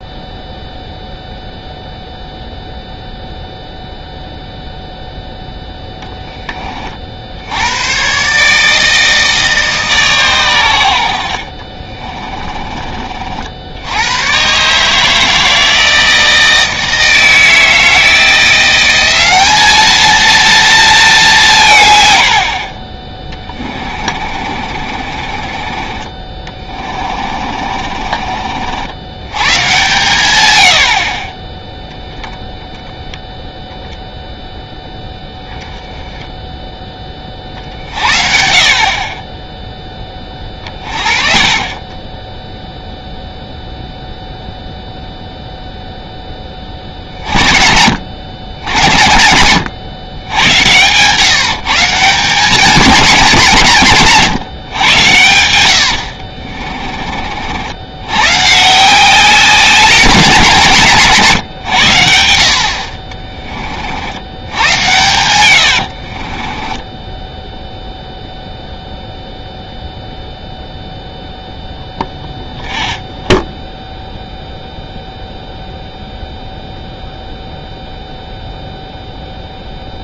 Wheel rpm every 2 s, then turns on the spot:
0, 0, 0, 40, 150, 90, 30, 140, 160, 180, 220, 60, 40, 30, 70, 70, 10, 0, 10, 40, 30, 10, 0, 40, 100, 120, 200, 120, 40, 160, 160, 40, 100, 20, 0, 0, 0, 0, 0, 0.
24-28 56-58 64-68